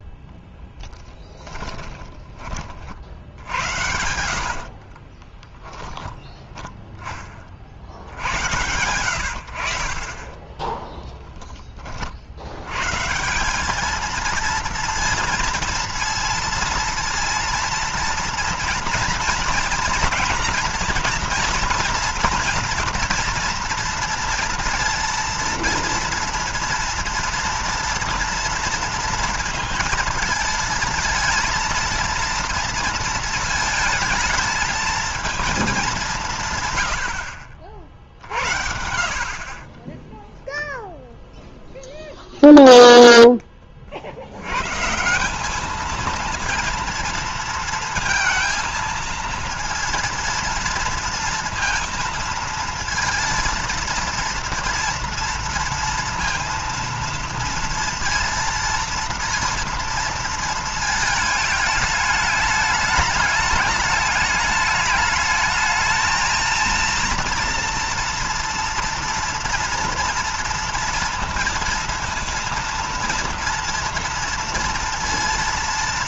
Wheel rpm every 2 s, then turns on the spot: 20, 50, 50, 30, 80, 10, 110, 230, 230, 230, 230, 230, 230, 230, 230, 230, 230, 220, 110, 70, 0, 0, 130, 230, 230, 230, 230, 230, 230, 230, 220, 210, 210, 230, 230, 230, 230, 230.
0-2 4-6 10-12